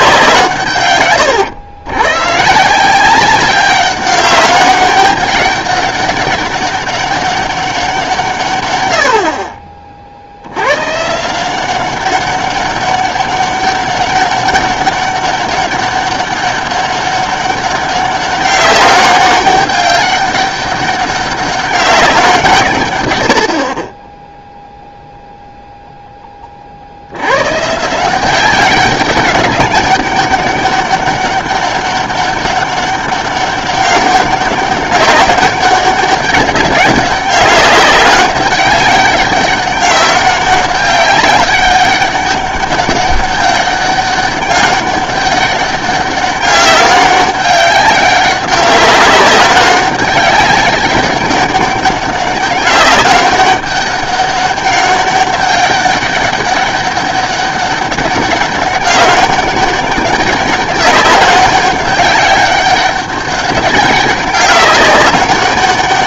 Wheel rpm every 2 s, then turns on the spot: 140, 150, 200, 200, 120, 100, 200, 200, 200, 190, 200, 150, 0, 40, 190, 200, 200, 200, 200, 190, 200, 200, 200, 200, 200, 200, 200, 200, 200, 200, 200, 200, 200.
none